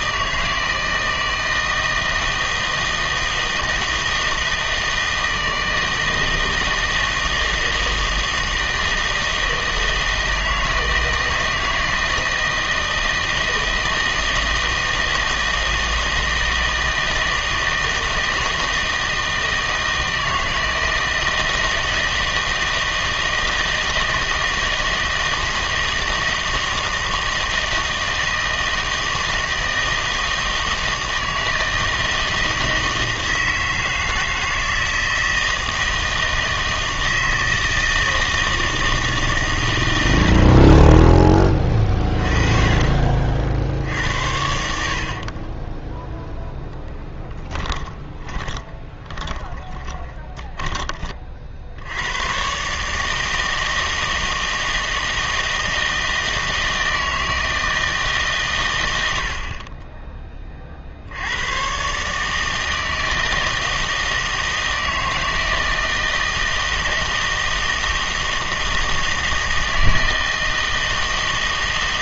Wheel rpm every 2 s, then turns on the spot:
160, 160, 160, 160, 160, 160, 160, 160, 160, 160, 160, 160, 160, 160, 160, 160, 160, 160, 160, 160, 40, 30, 60, 0, 20, 20, 130, 160, 160, 110, 40, 160, 160, 160, 160, 160.
48-52